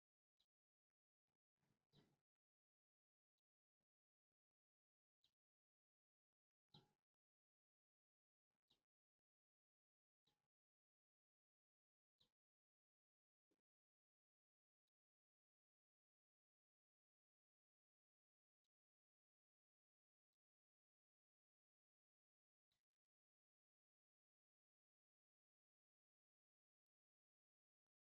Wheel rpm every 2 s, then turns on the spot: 0, 0, 0, 0, 0, 0, 0, 0, 0, 0, 0, 0, 0, 0.
none